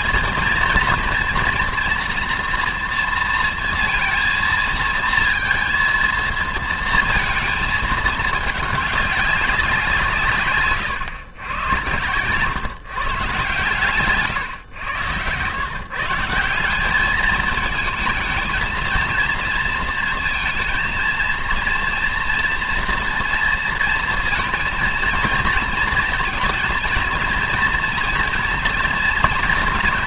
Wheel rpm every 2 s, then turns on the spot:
230, 230, 230, 220, 200, 140, 150, 100, 200, 220, 230, 230, 230, 220, 230.
none